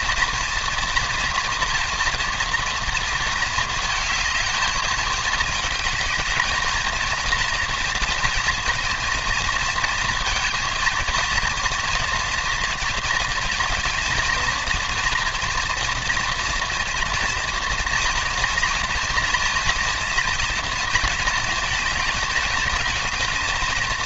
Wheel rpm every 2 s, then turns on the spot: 230, 230, 220, 230, 230, 230, 230, 230, 230, 230, 230, 220.
none